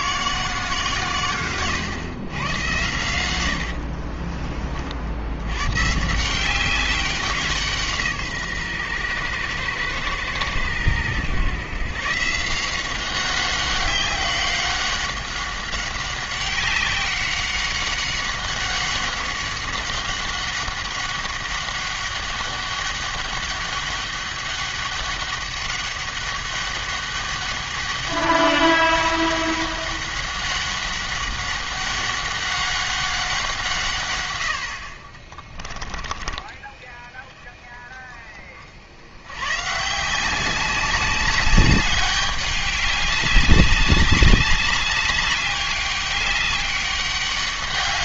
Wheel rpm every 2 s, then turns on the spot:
160, 120, 40, 190, 130, 110, 170, 190, 190, 190, 190, 200, 200, 200, 200, 190, 190, 70, 20, 60, 190, 200, 200, 200.
none